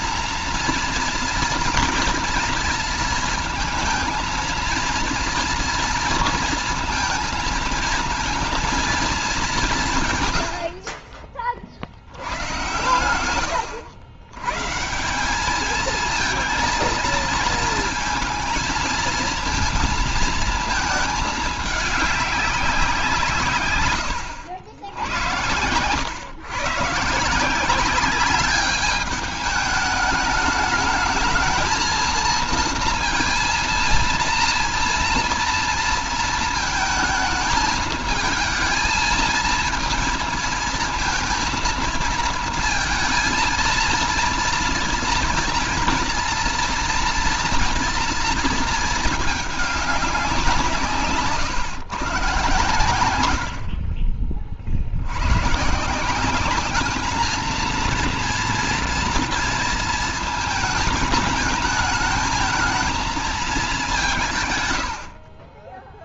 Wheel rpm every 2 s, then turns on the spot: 230, 230, 230, 230, 230, 60, 110, 150, 230, 230, 220, 180, 90, 150, 200, 210, 230, 230, 230, 220, 230, 230, 230, 230, 220, 150, 120, 60, 200, 230, 220, 220, 100.
none